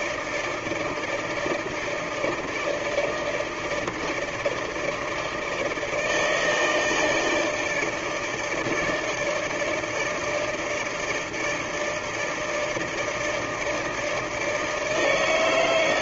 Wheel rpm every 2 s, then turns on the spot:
160, 160, 150, 160, 160, 160, 160, 160.
none